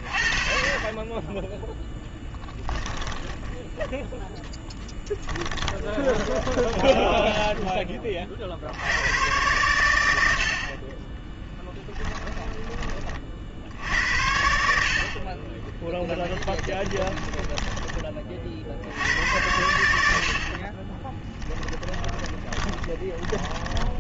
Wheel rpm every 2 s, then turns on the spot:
0, 10, 20, 20, 100, 10, 70, 30, 20, 80, 10, 20.
2-6 10-12 14-18 20-24